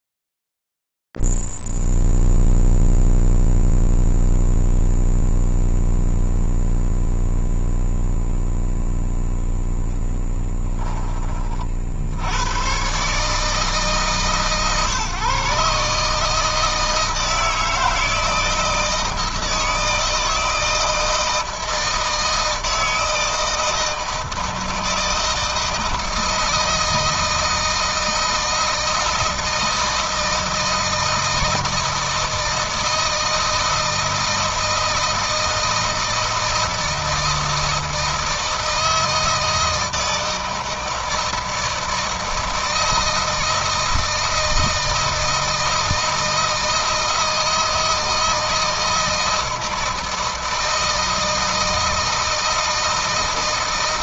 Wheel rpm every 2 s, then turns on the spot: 0, 0, 0, 0, 0, 10, 100, 140, 150, 160, 160, 160, 160, 160, 160, 160, 160, 160, 160, 160, 160, 160, 160, 160, 160, 160, 160.
none